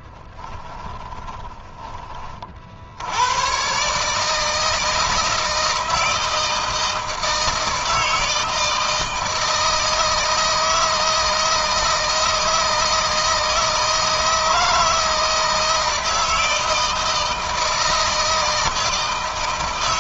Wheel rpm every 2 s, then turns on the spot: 20, 60, 160, 160, 160, 160, 160, 160, 160, 160.
0-2